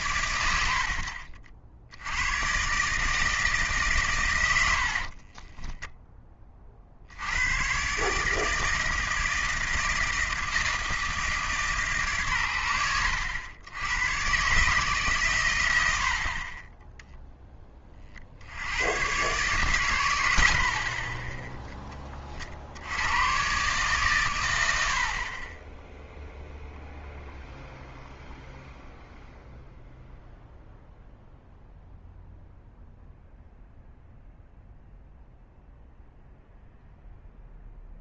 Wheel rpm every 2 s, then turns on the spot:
80, 130, 90, 30, 160, 160, 100, 140, 20, 90, 60, 50, 90, 0, 0, 0, 0, 0, 0.
none